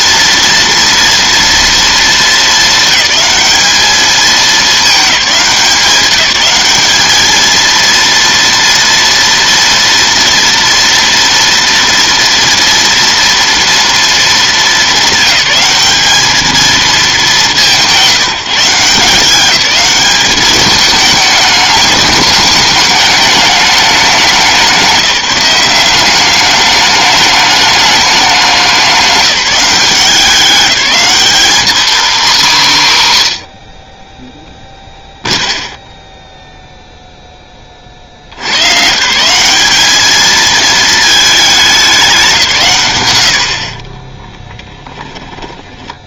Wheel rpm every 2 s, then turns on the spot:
230, 220, 220, 190, 230, 230, 230, 210, 220, 180, 210, 210, 180, 200, 200, 190, 190, 0, 0, 110, 220, 150, 10.
none